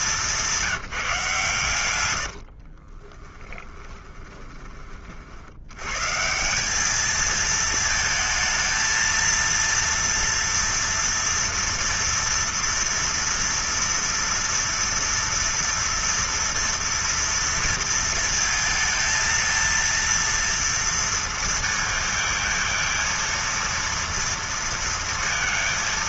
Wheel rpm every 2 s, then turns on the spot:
190, 80, 20, 150, 220, 230, 230, 230, 230, 230, 230, 230, 230.
2-6